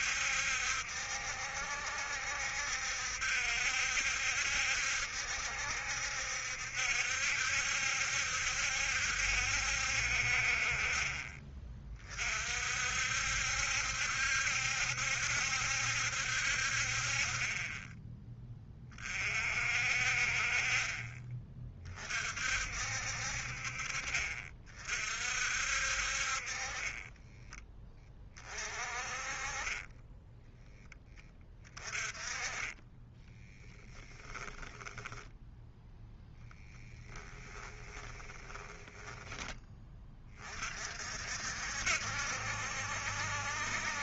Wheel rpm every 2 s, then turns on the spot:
70, 70, 70, 70, 70, 40, 60, 70, 50, 30, 30, 60, 50, 30, 40, 10, 20, 10, 10, 20, 50, 70.
34-40